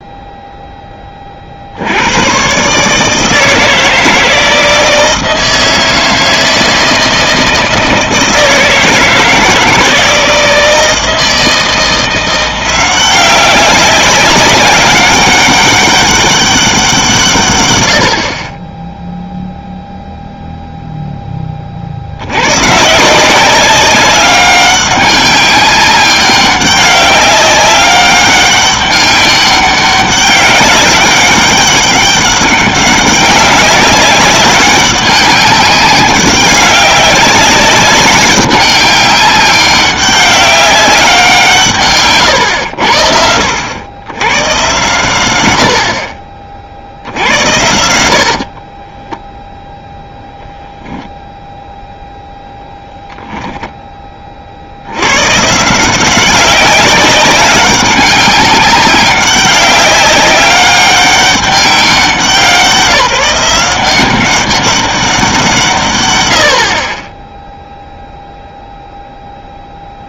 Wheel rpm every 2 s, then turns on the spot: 0, 140, 160, 160, 160, 160, 180, 190, 190, 20, 0, 130, 200, 200, 200, 200, 190, 190, 200, 200, 200, 90, 110, 50, 30, 0, 0, 50, 190, 190, 200, 170, 200, 60, 0.
48-50